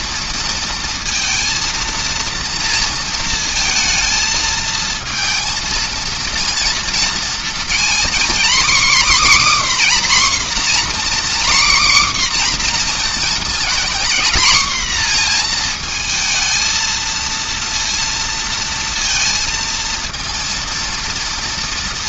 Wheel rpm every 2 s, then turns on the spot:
230, 230, 220, 230, 260, 260, 250, 240, 220, 230, 230.
none